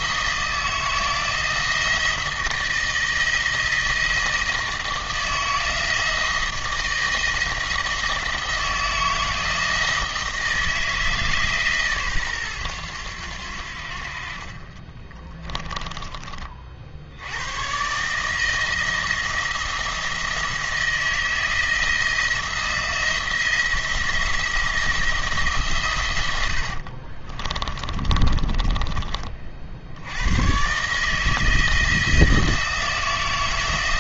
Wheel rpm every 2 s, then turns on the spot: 170, 160, 160, 160, 160, 160, 110, 30, 50, 170, 170, 170, 170, 70, 30, 130, 170.
14-16 26-30